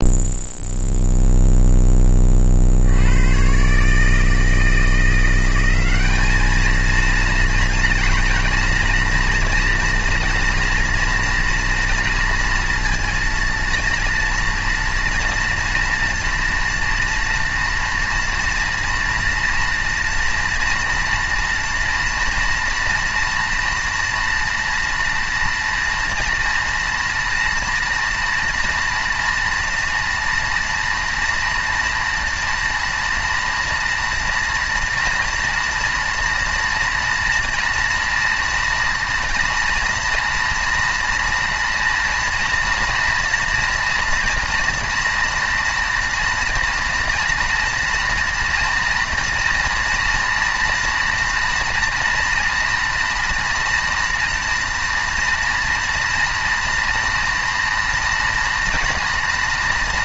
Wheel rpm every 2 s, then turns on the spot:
0, 40, 160, 220, 240, 240, 230, 230, 230, 230, 230, 230, 230, 230, 240, 240, 230, 230, 230, 230, 230, 230, 240, 230, 230, 230, 230, 230, 230, 230.
none